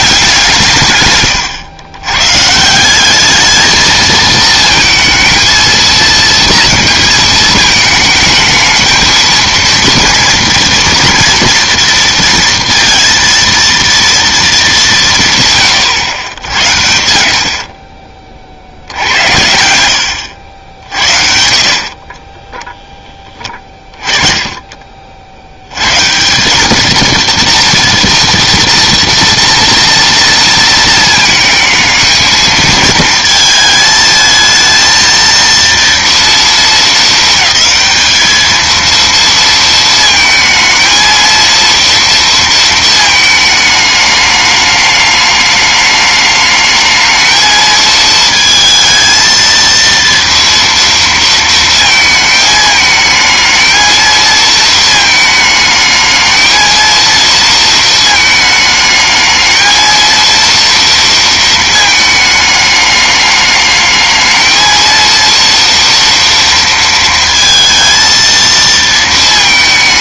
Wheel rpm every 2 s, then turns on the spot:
160, 160, 220, 230, 220, 230, 230, 210, 80, 60, 70, 10, 40, 210, 230, 230, 220, 220, 220, 220, 220, 230, 210, 220, 220, 230, 220, 220, 230, 220, 230, 210, 230, 230, 230.
none